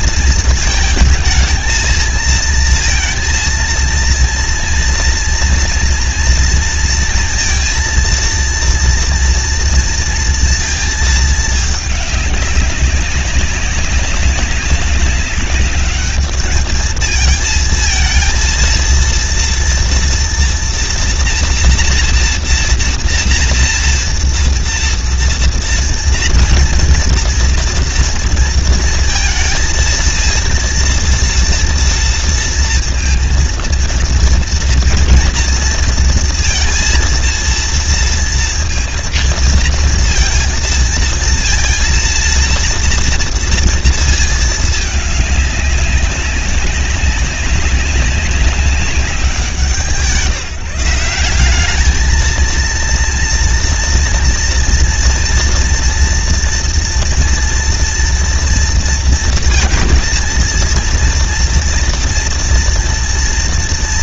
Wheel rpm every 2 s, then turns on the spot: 220, 220, 230, 230, 230, 230, 200, 200, 210, 230, 240, 230, 230, 230, 230, 230, 230, 230, 230, 230, 230, 230, 220, 190, 200, 170, 230, 230, 230, 230, 230, 240.
none